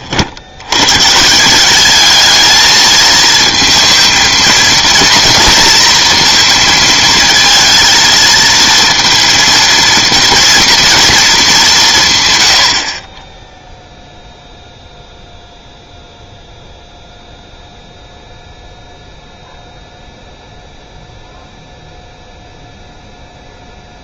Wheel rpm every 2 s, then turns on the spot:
100, 220, 230, 220, 230, 230, 60, 0, 0, 0, 0, 0.
none